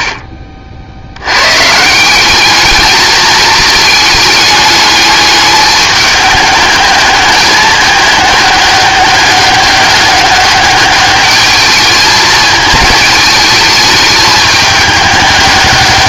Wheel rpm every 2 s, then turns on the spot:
50, 210, 210, 210, 200, 200, 220, 210.
none